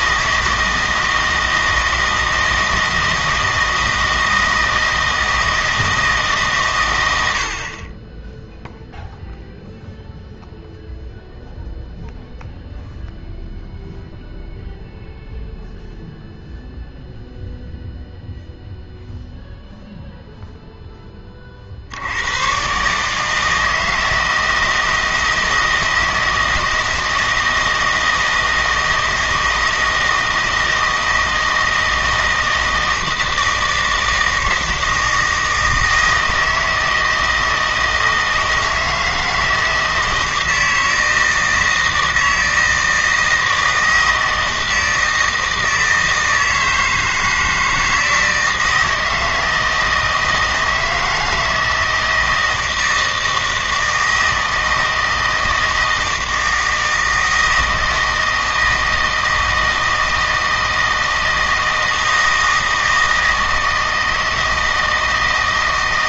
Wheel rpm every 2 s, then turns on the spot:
160, 160, 160, 110, 0, 0, 0, 0, 0, 0, 10, 130, 160, 160, 160, 160, 160, 160, 160, 160, 160, 160, 160, 160, 160, 160, 160, 160, 160, 160, 160, 160, 160.
none